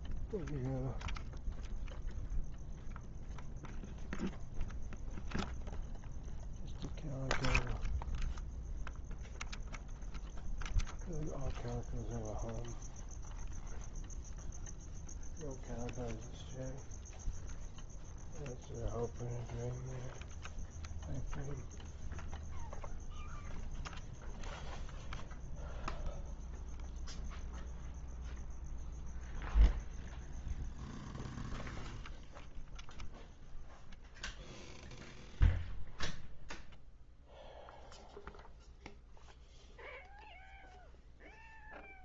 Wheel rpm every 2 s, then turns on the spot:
0, 0, 0, 0, 0, 0, 0, 0, 0, 0, 0, 0, 0, 0, 0, 0, 0, 0, 0, 0, 0.
none